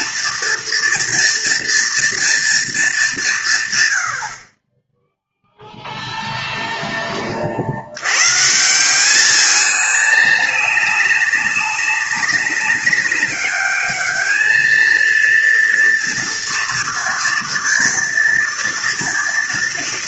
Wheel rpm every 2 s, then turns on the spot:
230, 200, 10, 10, 180, 200, 200, 230, 230, 230.
none